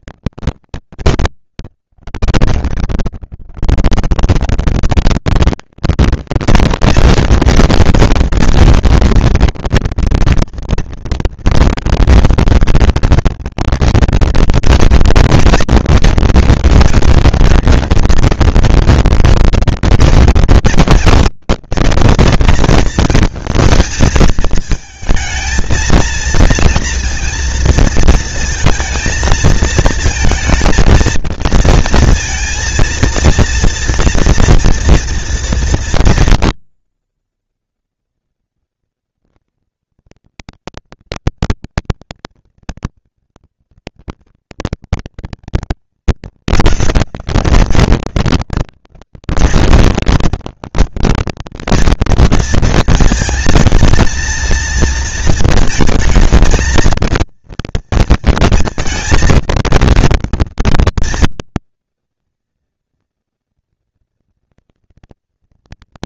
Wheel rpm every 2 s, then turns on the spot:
180, 110, 190, 230, 220, 230, 230, 230, 220, 230, 230, 230, 220, 230, 230, 230, 230, 230, 230, 230, 230, 220, 230, 210, 190, 200, 230, 230, 220, 230, 230, 230, 230.
none